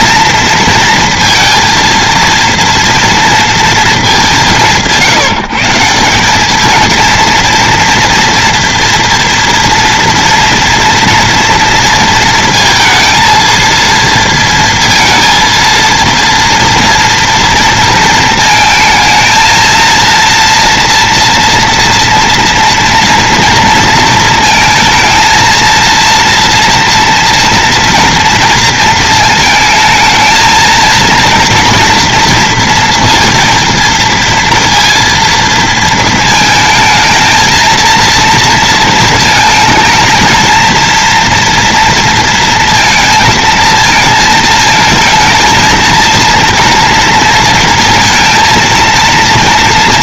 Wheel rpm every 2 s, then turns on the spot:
230, 230, 150, 230, 230, 230, 230, 230, 240, 230, 230, 230, 220, 230, 230, 220, 230, 230, 220, 230, 230, 230, 220, 230, 230.
none